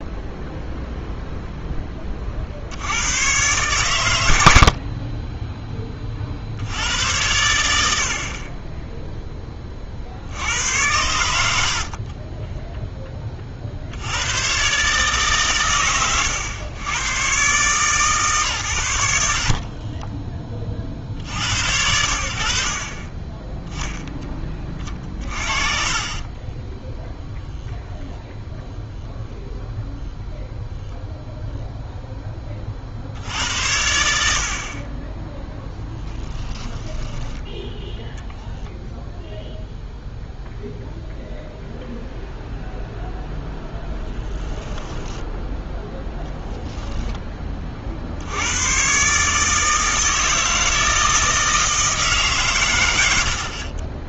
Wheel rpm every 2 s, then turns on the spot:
0, 80, 60, 90, 20, 90, 10, 130, 100, 100, 40, 50, 20, 20, 0, 0, 50, 50, 10, 0, 0, 0, 10, 0, 100, 160, 130.
4-6 26-28 36-38 44-46